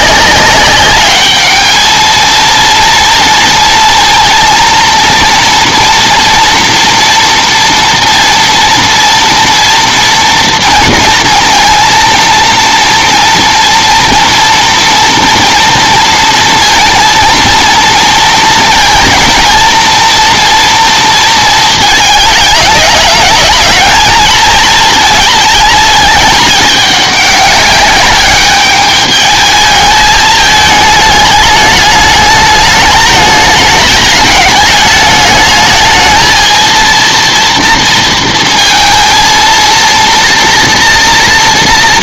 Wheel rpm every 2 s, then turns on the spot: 200, 230, 230, 230, 230, 230, 230, 230, 230, 230, 230, 210, 220, 210, 200, 210, 210, 210, 230, 230, 240.
none